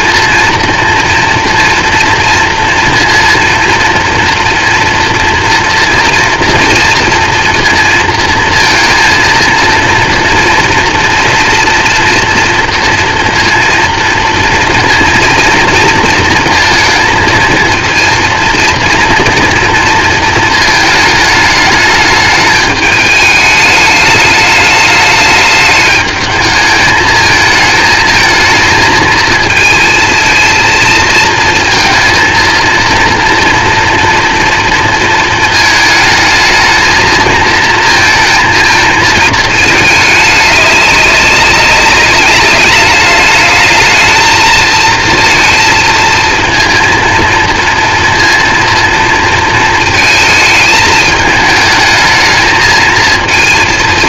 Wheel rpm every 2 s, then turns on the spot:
230, 230, 230, 230, 230, 230, 230, 230, 230, 230, 220, 210, 210, 210, 220, 220, 230, 230, 220, 230, 210, 200, 220, 230, 230, 220, 220.
none